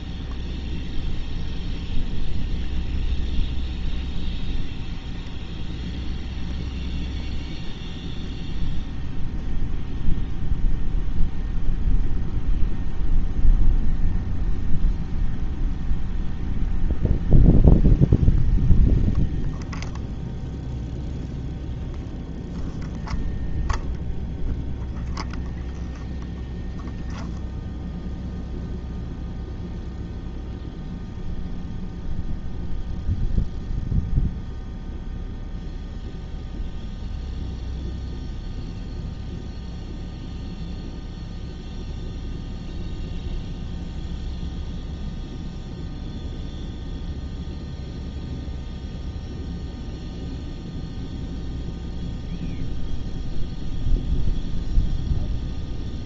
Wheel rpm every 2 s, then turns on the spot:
0, 0, 0, 0, 0, 0, 0, 0, 0, 0, 0, 0, 0, 0, 0, 0, 0, 0, 0, 0, 0, 0, 0, 0, 0, 0, 0, 0.
none